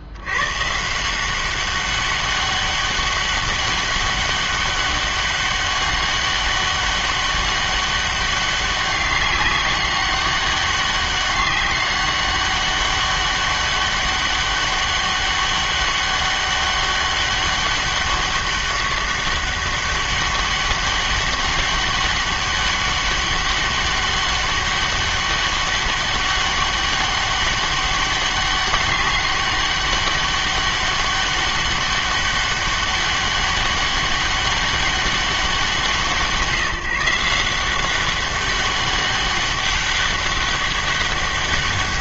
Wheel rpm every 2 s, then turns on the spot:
130, 200, 200, 200, 200, 200, 200, 200, 200, 200, 200, 200, 200, 200, 200, 200, 200, 200, 170, 200, 200.
none